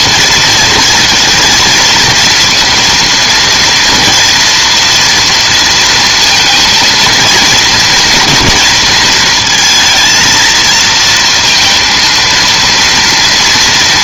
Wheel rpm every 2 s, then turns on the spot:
230, 240, 230, 230, 230, 230, 230.
none